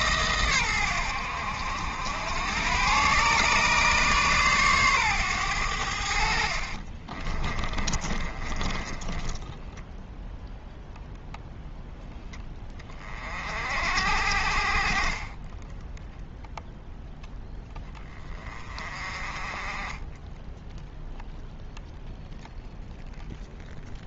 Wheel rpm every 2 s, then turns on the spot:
110, 110, 130, 40, 30, 0, 20, 50, 0, 30, 0, 0.
6-10